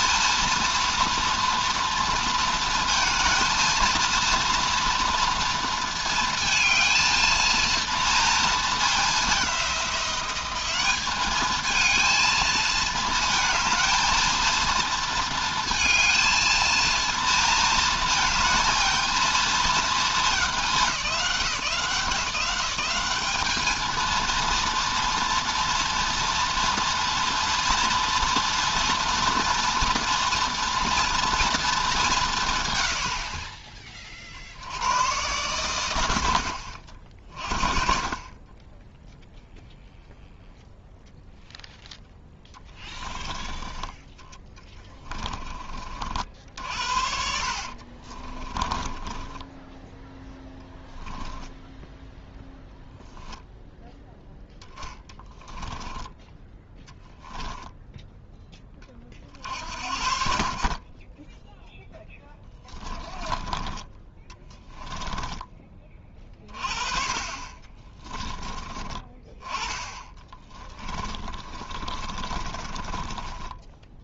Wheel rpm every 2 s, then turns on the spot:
230, 220, 230, 230, 210, 200, 220, 230, 230, 230, 200, 200, 230, 230, 230, 240, 80, 110, 50, 10, 0, 10, 20, 70, 20, 10, 0, 10, 10, 30, 30, 30, 10, 30, 20, 20, 20.
46-52 54-56 62-66 70-74